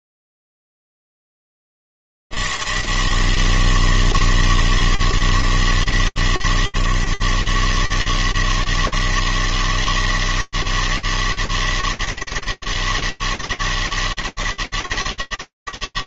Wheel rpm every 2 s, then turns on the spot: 80, 160, 160, 150, 150, 160, 160, 160.
none